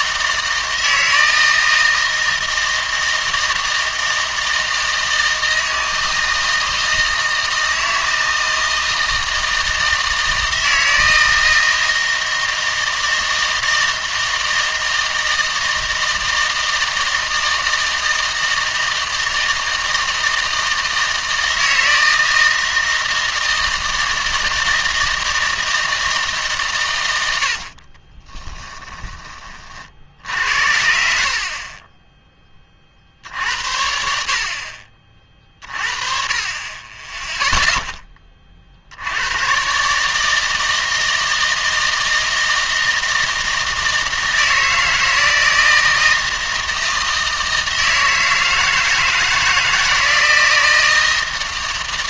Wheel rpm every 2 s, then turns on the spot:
160, 160, 160, 160, 160, 160, 160, 160, 160, 160, 160, 160, 160, 130, 20, 80, 30, 50, 30, 50, 160, 160, 160, 160, 160, 160.
28-30